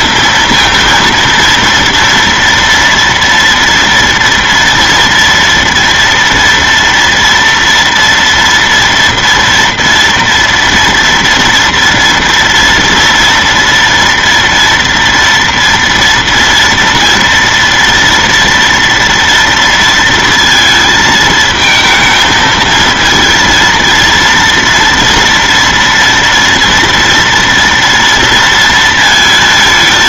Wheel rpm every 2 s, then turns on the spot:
230, 230, 230, 240, 230, 230, 230, 240, 230, 230, 230, 220, 230, 230, 230.
none